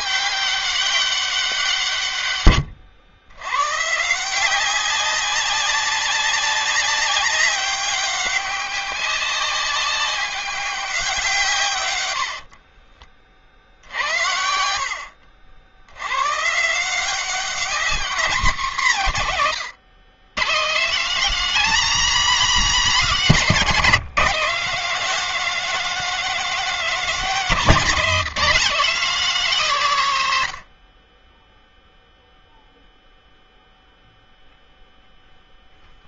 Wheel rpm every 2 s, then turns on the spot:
200, 100, 190, 190, 190, 200, 40, 70, 160, 200, 170, 230, 210, 230, 220, 60, 0, 0.
12-14